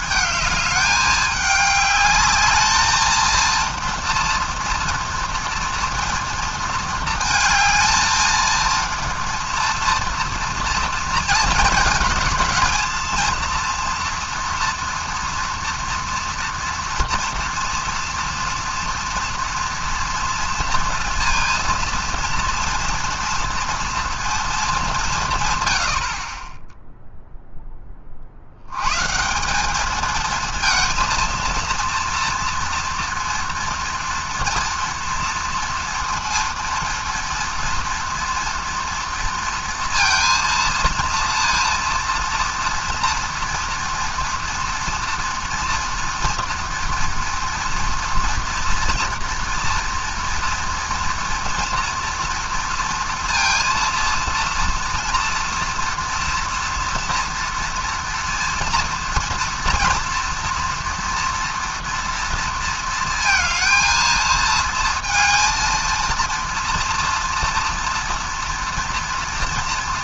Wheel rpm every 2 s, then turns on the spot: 210, 210, 230, 230, 230, 240, 220, 230, 230, 230, 230, 230, 220, 20, 90, 230, 230, 230, 230, 230, 230, 230, 240, 230, 230, 240, 230, 230, 230, 230, 230, 230, 230, 230, 230.
none